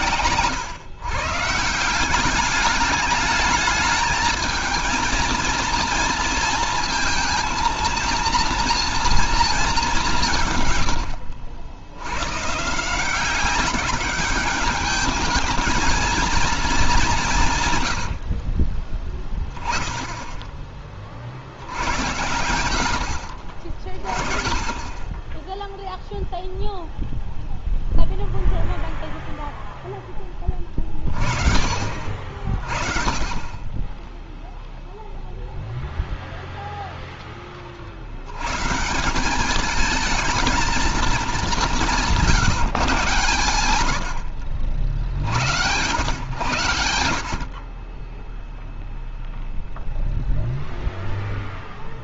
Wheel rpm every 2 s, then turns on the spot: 120, 190, 220, 230, 230, 160, 130, 200, 230, 40, 10, 90, 20, 0, 0, 20, 40, 0, 0, 110, 220, 150, 60, 100, 0, 0.
18-20